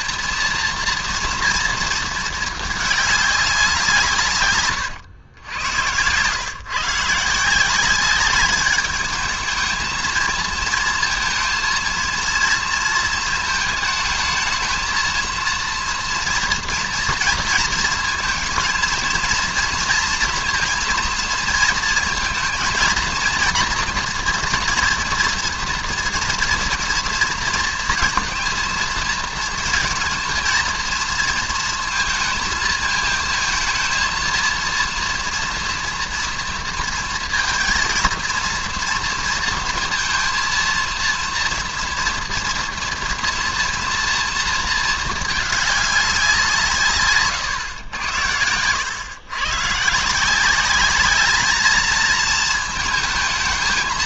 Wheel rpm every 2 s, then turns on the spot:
230, 210, 120, 130, 200, 230, 230, 230, 230, 230, 240, 230, 230, 230, 230, 230, 230, 230, 230, 230, 230, 230, 230, 160, 100, 200, 220.
4-6